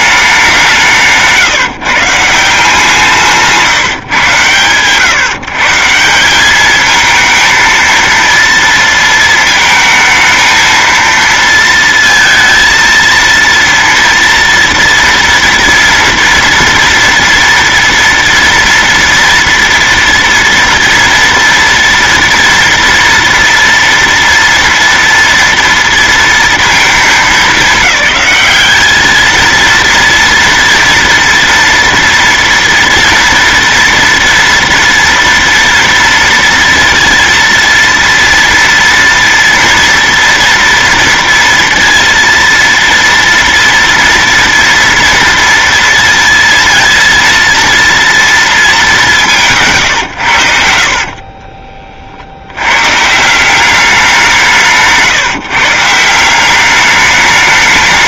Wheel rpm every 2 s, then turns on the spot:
190, 170, 130, 210, 230, 230, 230, 230, 230, 230, 230, 230, 230, 230, 210, 230, 230, 230, 230, 230, 230, 230, 230, 230, 220, 80, 100, 170, 200.
50-52